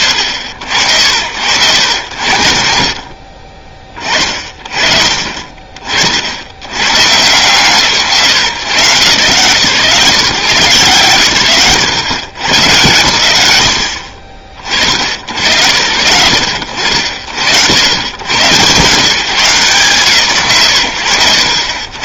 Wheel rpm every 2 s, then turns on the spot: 60, 80, 50, 90, 130, 160, 120, 40, 90, 120, 100.
none